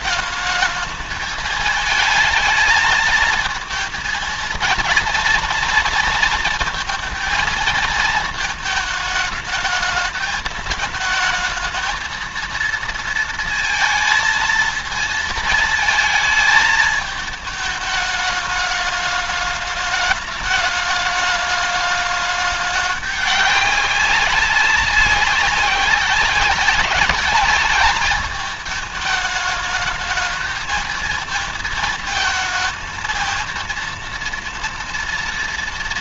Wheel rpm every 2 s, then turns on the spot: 220, 220, 230, 230, 220, 220, 230, 230, 220, 210, 210, 210, 200, 190, 220, 220, 220, 230.
none